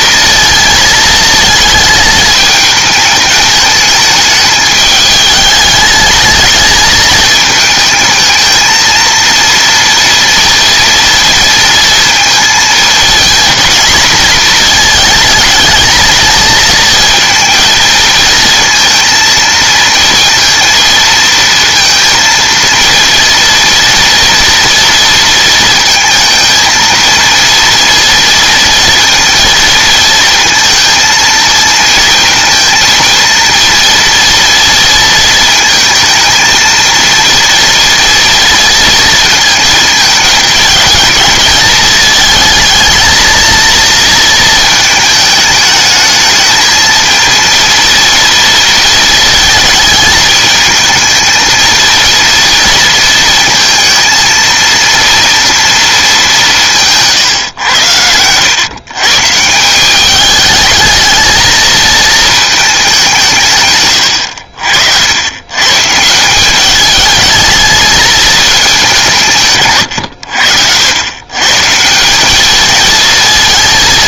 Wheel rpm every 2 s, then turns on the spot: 230, 220, 210, 220, 220, 230, 230, 230, 230, 230, 230, 230, 230, 220, 230, 230, 230, 230, 220, 230, 220, 220, 230, 220, 230, 220, 230, 230, 170, 120, 220, 220, 70, 200, 200, 80, 210.
none